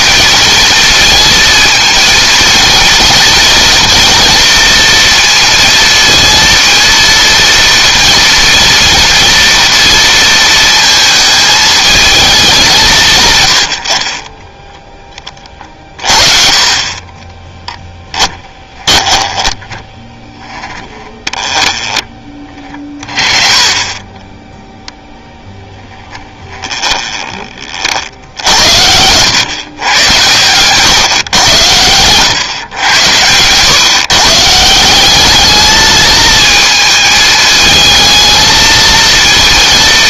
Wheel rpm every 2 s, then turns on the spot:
220, 220, 230, 230, 230, 230, 190, 10, 40, 20, 10, 30, 0, 10, 90, 120, 120, 160, 220, 230.
14-16 18-20 26-30